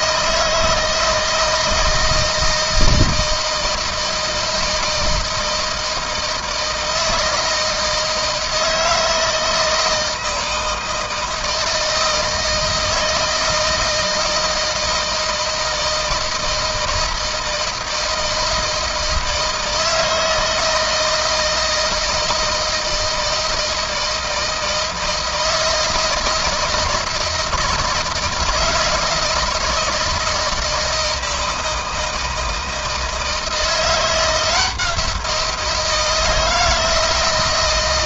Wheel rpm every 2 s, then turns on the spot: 160, 160, 160, 160, 160, 160, 160, 160, 160, 160, 160, 160, 160, 160, 160, 160, 160, 170, 160.
none